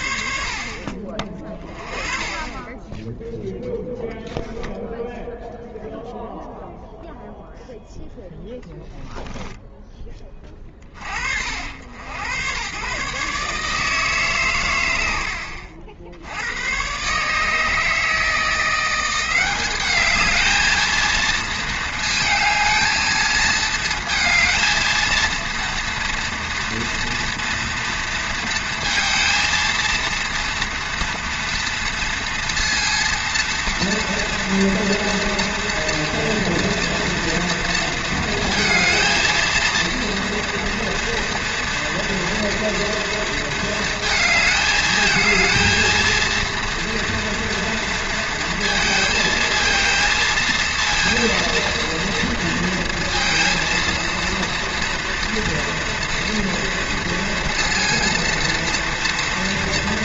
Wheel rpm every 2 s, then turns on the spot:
60, 20, 0, 0, 10, 20, 100, 130, 90, 170, 220, 220, 220, 230, 230, 230, 230, 230, 230, 220, 230, 230, 220, 230, 230, 230, 230, 230, 230, 230.
8-10